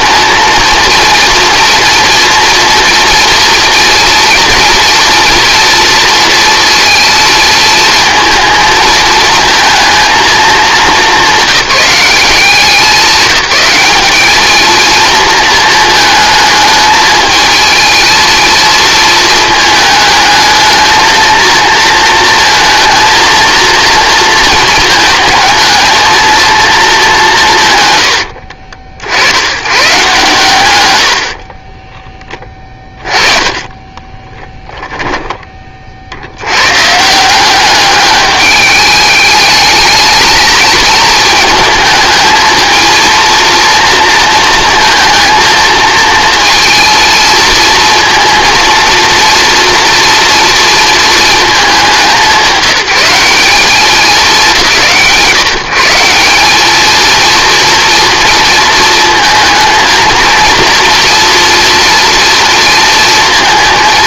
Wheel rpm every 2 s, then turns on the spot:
230, 230, 230, 230, 220, 220, 190, 220, 220, 220, 220, 230, 220, 220, 60, 110, 20, 10, 130, 210, 220, 220, 230, 230, 230, 230, 190, 180, 220, 230, 230, 230.
32-36